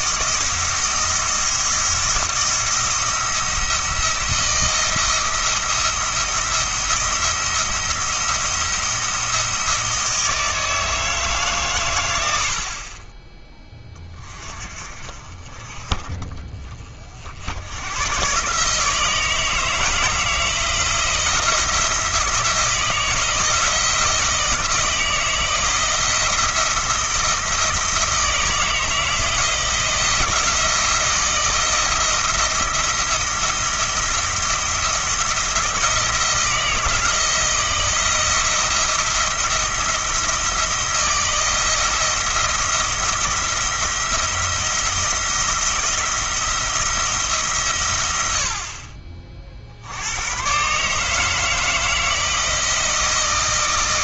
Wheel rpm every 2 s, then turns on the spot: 170, 170, 170, 170, 170, 160, 50, 40, 40, 150, 170, 160, 160, 160, 160, 170, 170, 170, 160, 170, 170, 170, 170, 170, 50, 130, 160.
none